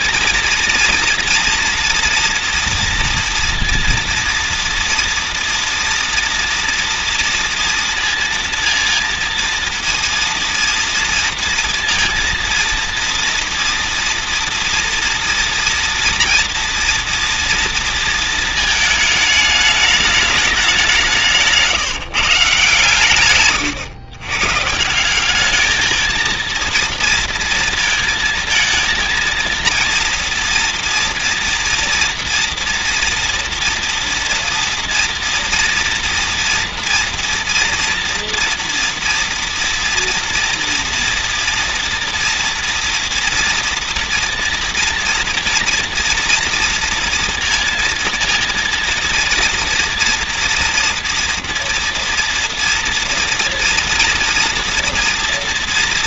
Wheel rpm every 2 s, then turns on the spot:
230, 230, 230, 230, 230, 230, 230, 240, 230, 230, 210, 150, 130, 230, 230, 230, 230, 230, 230, 240, 230, 230, 240, 230, 230, 230, 240, 240.
none